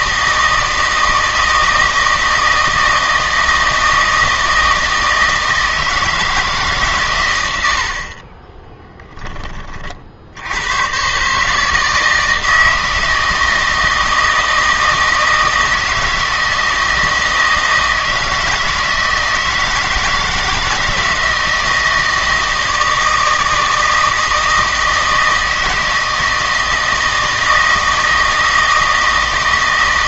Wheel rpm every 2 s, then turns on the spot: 160, 160, 160, 150, 20, 110, 160, 160, 160, 160, 160, 160, 160, 160, 160.
8-10